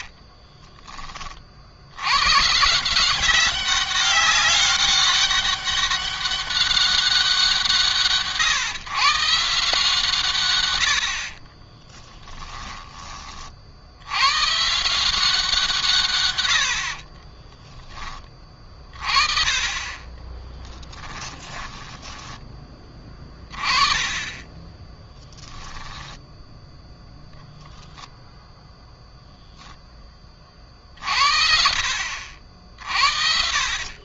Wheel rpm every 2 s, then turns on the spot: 20, 130, 200, 200, 150, 120, 10, 120, 100, 30, 30, 30, 20, 10, 10, 40, 60.
0-2 12-14 20-24